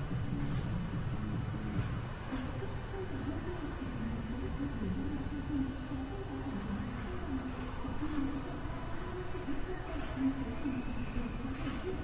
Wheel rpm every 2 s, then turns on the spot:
0, 0, 0, 0, 0, 0.
none